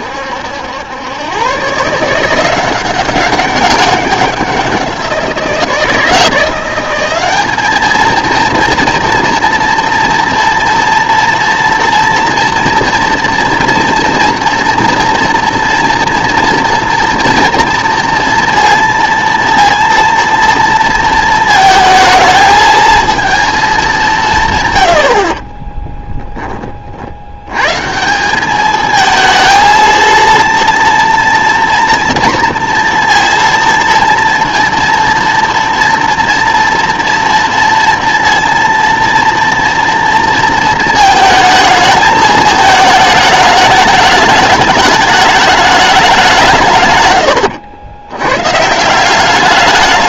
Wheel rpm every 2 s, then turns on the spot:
90, 180, 180, 180, 230, 230, 240, 230, 230, 230, 230, 220, 130, 40, 210, 230, 230, 230, 230, 230, 220, 220, 210, 140, 160.
none